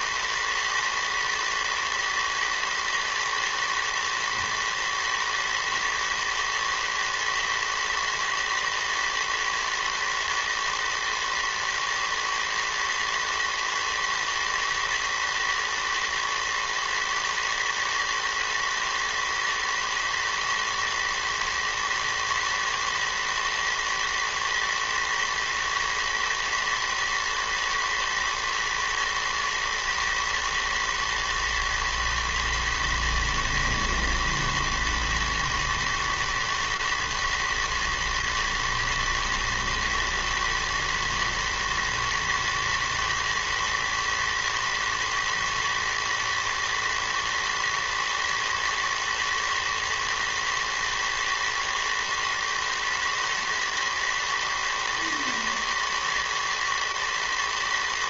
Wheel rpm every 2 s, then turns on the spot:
110, 110, 110, 110, 110, 110, 110, 110, 110, 110, 110, 120, 110, 120, 120, 110, 110, 110, 110, 110, 120, 110, 110, 110, 110, 110, 110, 110, 110.
none